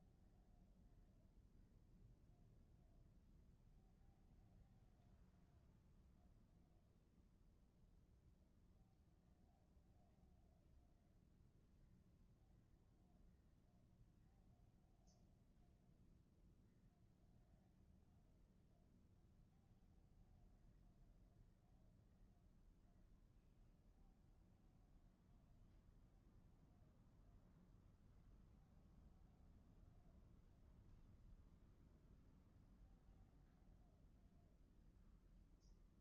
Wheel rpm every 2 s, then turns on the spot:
0, 0, 0, 0, 0, 0, 0, 0, 0, 0, 0, 0, 0, 0, 0, 0, 0, 0.
none